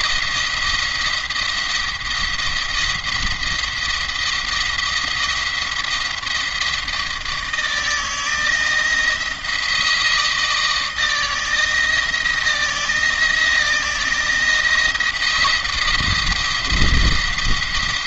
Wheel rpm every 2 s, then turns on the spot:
170, 170, 170, 170, 170, 160, 170, 170, 170.
none